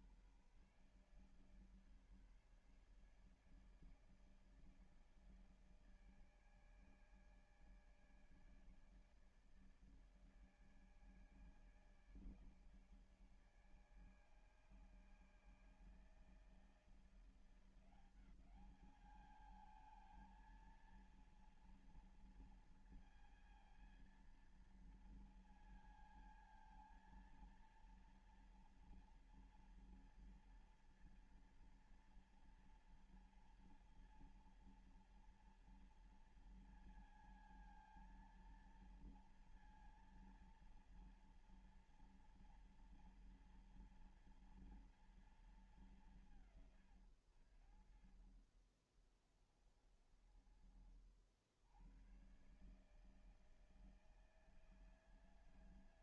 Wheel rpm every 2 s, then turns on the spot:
140, 150, 150, 150, 150, 150, 150, 150, 160, 180, 220, 230, 230, 230, 230, 230, 230, 230, 230, 230, 230, 230, 240, 200, 60, 30, 100, 160.
none